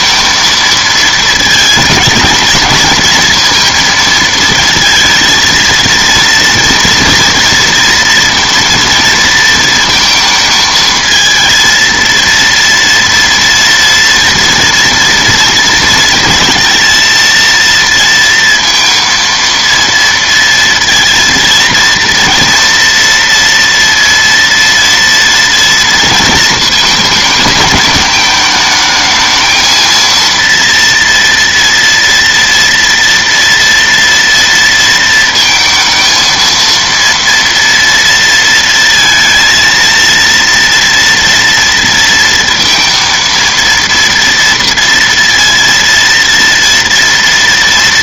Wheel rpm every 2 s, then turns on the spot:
220, 230, 230, 230, 230, 220, 230, 230, 230, 230, 230, 230, 230, 220, 220, 230, 230, 230, 230, 220, 230, 230, 230, 230.
none